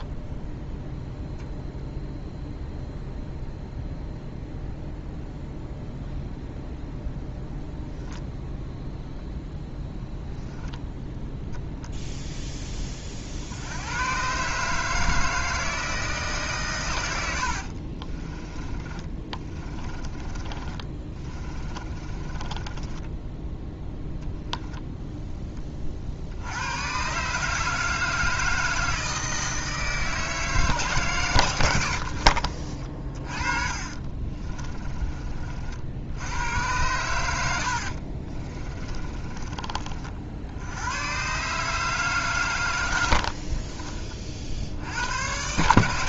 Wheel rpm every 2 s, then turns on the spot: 0, 0, 0, 0, 0, 0, 10, 140, 120, 20, 30, 20, 0, 100, 160, 150, 40, 30, 100, 30, 80, 110, 60.
18-24 32-36 38-40